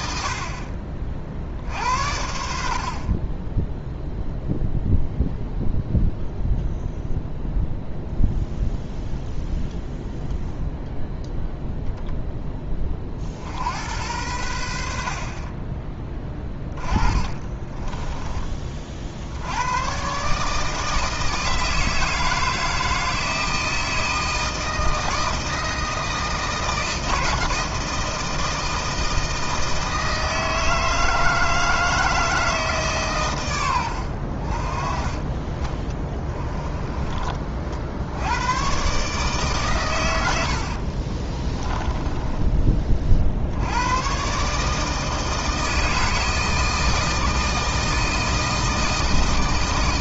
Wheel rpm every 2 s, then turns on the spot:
50, 60, 0, 0, 0, 0, 20, 70, 20, 30, 150, 160, 160, 160, 160, 160, 150, 40, 10, 130, 60, 30, 150, 160, 160.
16-18 36-38 40-42